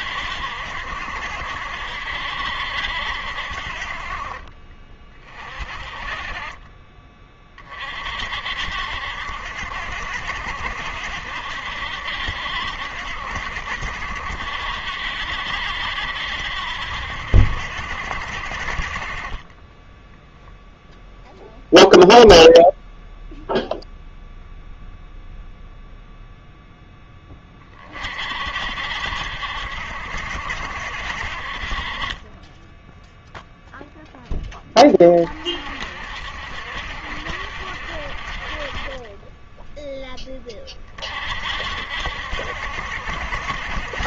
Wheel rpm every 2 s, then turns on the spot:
70, 70, 30, 30, 60, 70, 70, 70, 70, 40, 0, 0, 0, 10, 60, 70, 0, 20, 60, 30, 30, 70.
6-8